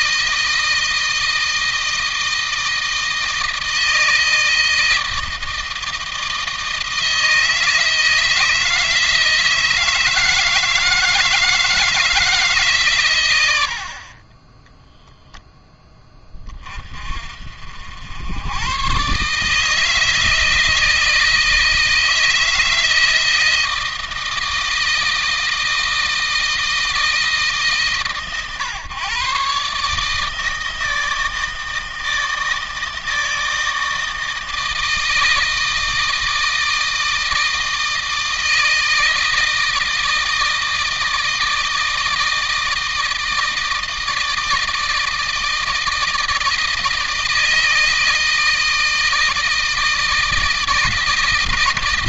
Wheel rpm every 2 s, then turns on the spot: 160, 160, 160, 160, 160, 160, 140, 10, 30, 120, 160, 160, 160, 160, 130, 160, 160, 160, 160, 160, 160, 160, 160, 160, 160, 160.
14-16